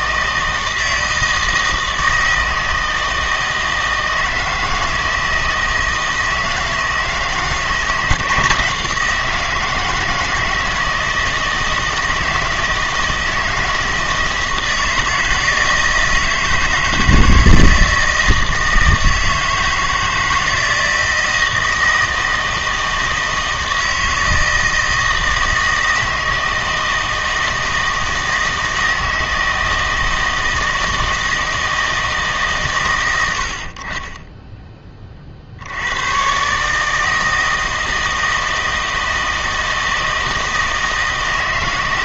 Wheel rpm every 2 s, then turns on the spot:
160, 160, 160, 160, 170, 160, 160, 160, 160, 160, 160, 160, 160, 160, 160, 160, 120, 10, 150, 160, 160.
none